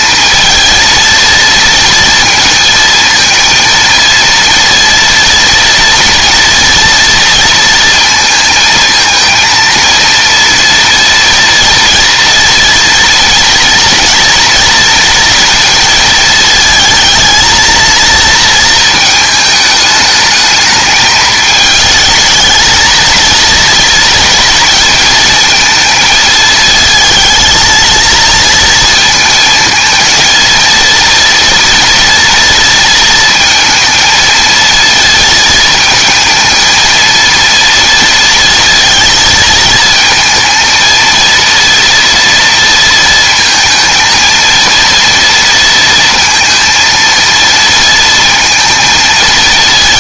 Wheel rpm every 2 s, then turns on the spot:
230, 220, 230, 230, 230, 230, 230, 230, 220, 230, 220, 220, 230, 220, 230, 230, 230, 230, 230, 230, 230, 230, 230, 230, 220.
none